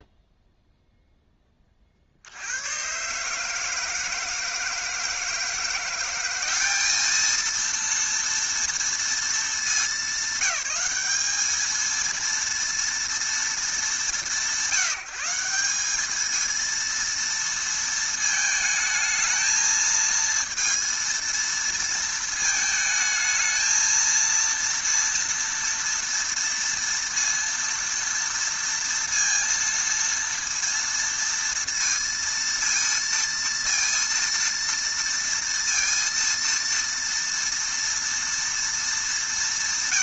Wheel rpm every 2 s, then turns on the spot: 0, 110, 160, 210, 230, 200, 230, 180, 230, 220, 230, 220, 230, 230, 230, 230, 230, 230, 230, 220.
none